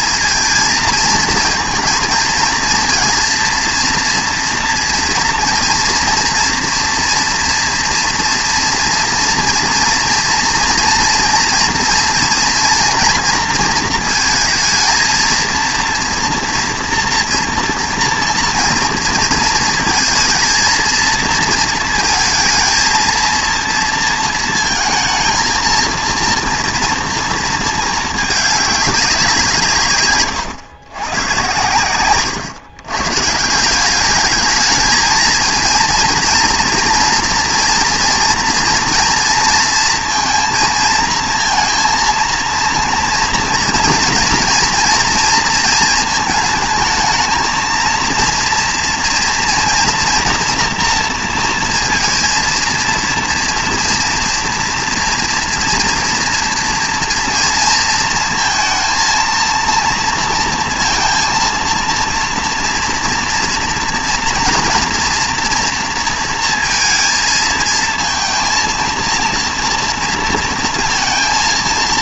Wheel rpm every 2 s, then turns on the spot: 230, 220, 230, 230, 230, 240, 240, 230, 230, 230, 230, 230, 230, 230, 210, 120, 140, 220, 230, 230, 230, 230, 230, 220, 230, 230, 230, 230, 230, 230, 230, 230, 240, 230, 230, 230.
none